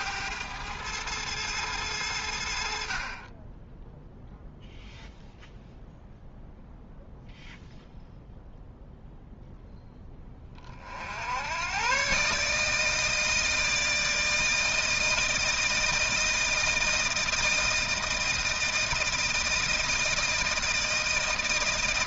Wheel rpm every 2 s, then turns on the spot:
110, 50, 0, 0, 0, 50, 150, 160, 160, 160, 160.
none